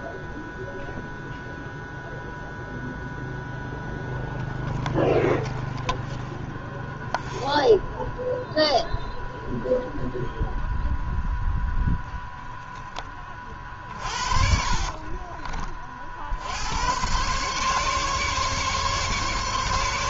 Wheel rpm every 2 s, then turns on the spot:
0, 0, 0, 0, 0, 0, 0, 40, 70, 140.
14-16